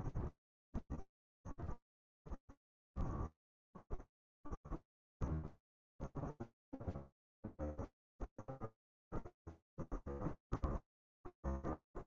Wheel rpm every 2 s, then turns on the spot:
0, 0, 0, 0, 0, 0.
none